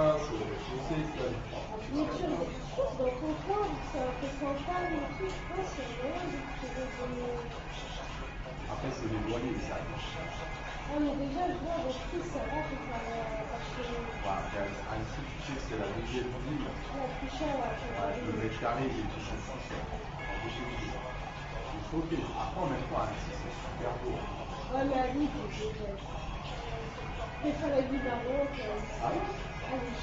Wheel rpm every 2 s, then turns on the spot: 0, 0, 0, 0, 0, 0, 0, 0, 0, 0, 0, 0, 0, 0, 0.
none